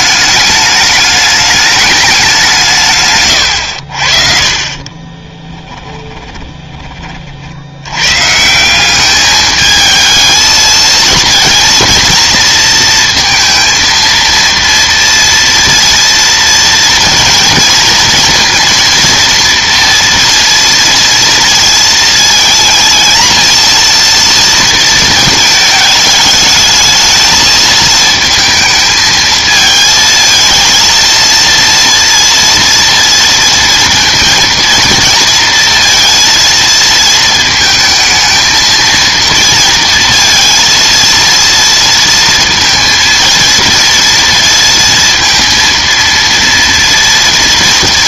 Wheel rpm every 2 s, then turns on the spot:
210, 180, 40, 20, 180, 230, 230, 230, 230, 230, 230, 230, 230, 210, 220, 230, 230, 230, 230, 220, 230, 230, 230, 230.
none